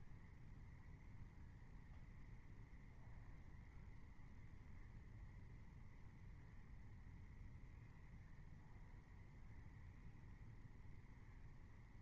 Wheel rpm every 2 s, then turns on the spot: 0, 0, 0, 0, 0, 0.
none